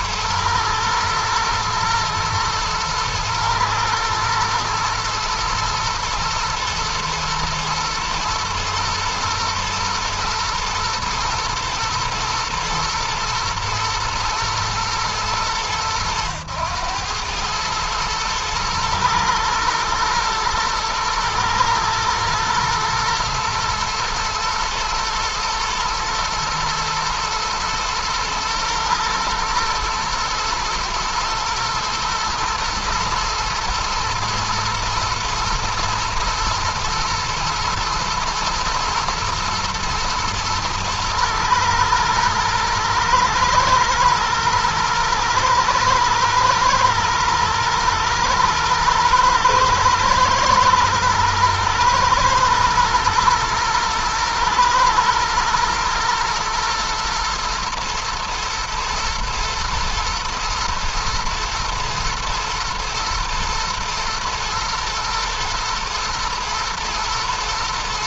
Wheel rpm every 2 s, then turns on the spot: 120, 110, 110, 110, 110, 120, 110, 110, 100, 120, 110, 110, 120, 110, 120, 120, 110, 110, 110, 110, 110, 110, 110, 110, 110, 110, 120, 120, 120, 120, 120, 110, 120, 110.
none